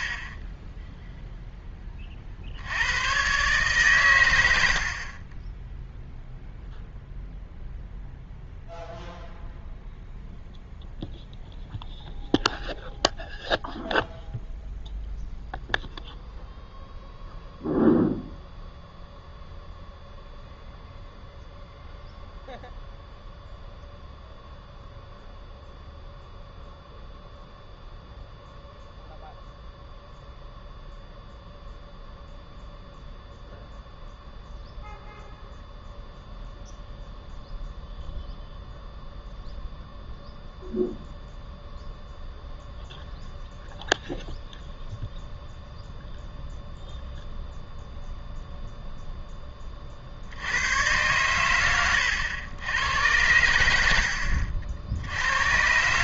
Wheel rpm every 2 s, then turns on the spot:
0, 100, 60, 0, 0, 0, 0, 0, 0, 0, 0, 0, 0, 0, 0, 0, 0, 0, 0, 0, 0, 0, 0, 0, 0, 100, 100, 70.
none